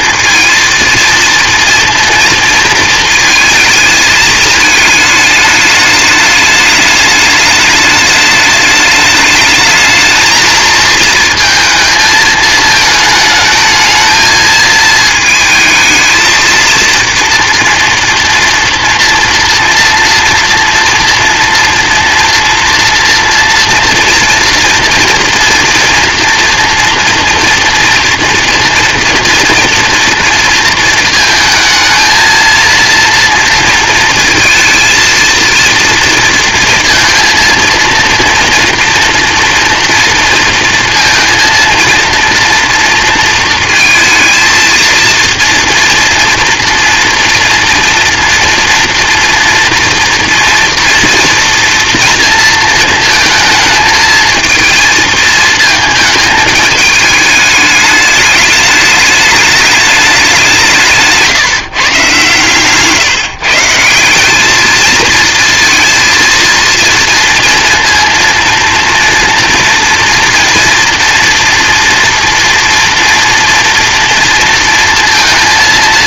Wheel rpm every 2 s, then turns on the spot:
230, 230, 220, 210, 210, 230, 220, 220, 230, 230, 230, 230, 230, 240, 240, 230, 230, 230, 230, 230, 230, 230, 230, 230, 240, 230, 230, 220, 210, 210, 190, 130, 220, 230, 230, 230, 240, 230.
none